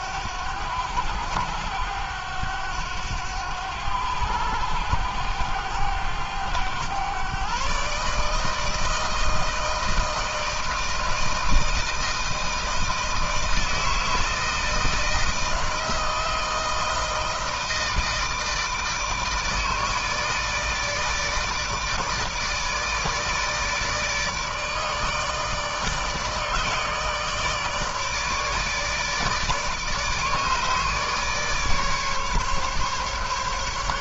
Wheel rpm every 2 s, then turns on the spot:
90, 100, 100, 110, 160, 160, 160, 160, 160, 160, 150, 160, 160, 150, 150, 150, 140.
none